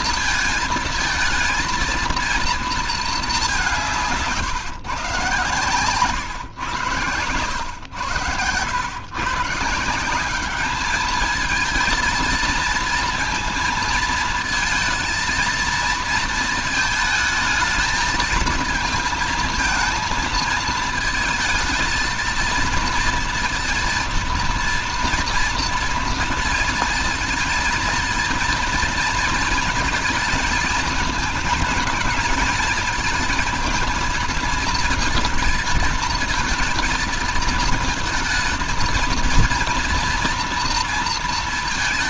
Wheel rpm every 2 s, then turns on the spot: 220, 220, 120, 110, 130, 210, 230, 230, 220, 220, 230, 230, 230, 230, 230, 220, 220, 230, 230, 230, 230.
none